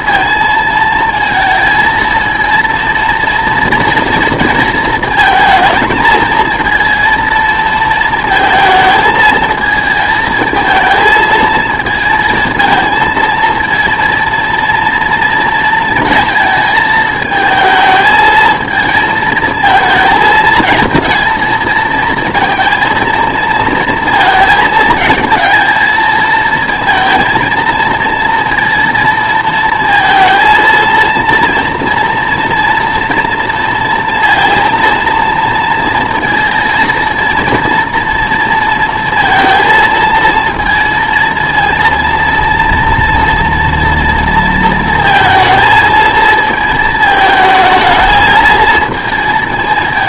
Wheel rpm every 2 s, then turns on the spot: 230, 230, 230, 230, 220, 220, 220, 230, 220, 220, 220, 220, 230, 230, 230, 230, 230, 230, 230, 230, 230, 230, 230, 220, 230.
none